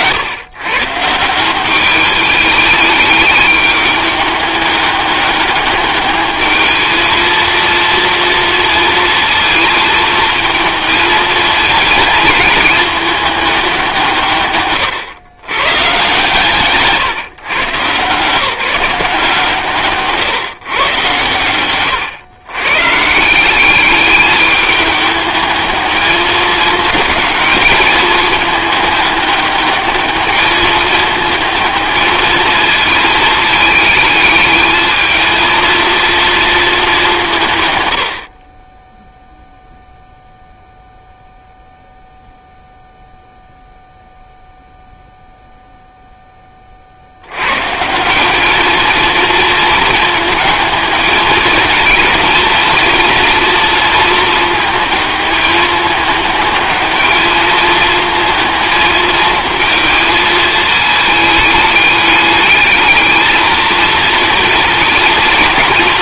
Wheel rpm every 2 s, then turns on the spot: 140, 210, 200, 220, 230, 220, 210, 130, 150, 170, 120, 150, 210, 210, 210, 210, 220, 220, 210, 10, 0, 0, 0, 40, 220, 220, 230, 220, 210, 220, 220, 210, 230.
none